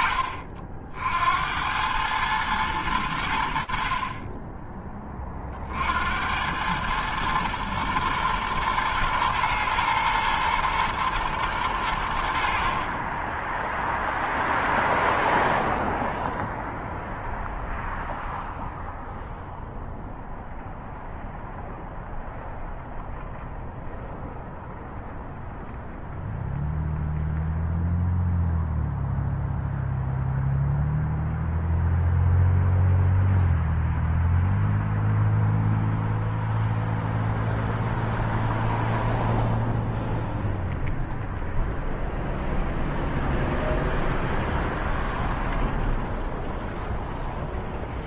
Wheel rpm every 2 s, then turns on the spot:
50, 110, 20, 90, 120, 110, 70, 0, 0, 0, 0, 0, 0, 0, 0, 0, 0, 0, 0, 0, 0, 0, 0, 0.
none